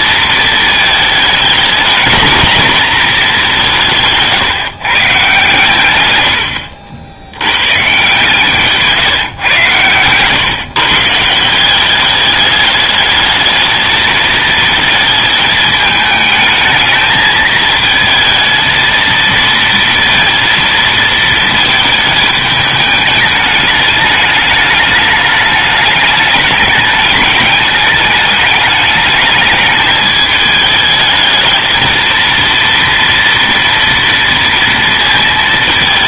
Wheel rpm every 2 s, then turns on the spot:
220, 240, 140, 80, 150, 140, 210, 230, 220, 220, 230, 210, 210, 210, 210, 220, 230, 230.
none